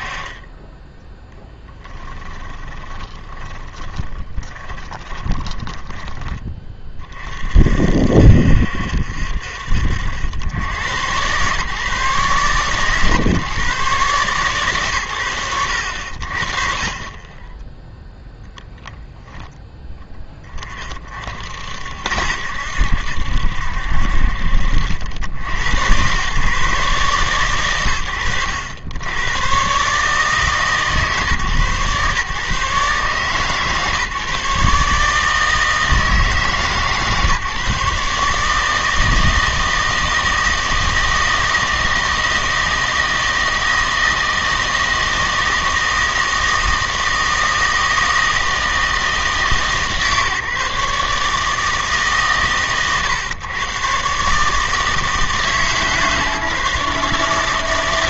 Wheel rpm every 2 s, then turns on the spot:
20, 20, 20, 20, 60, 90, 140, 130, 40, 0, 30, 70, 60, 140, 90, 150, 140, 150, 150, 160, 160, 160, 160, 160, 160, 150, 130, 150, 150.
2-6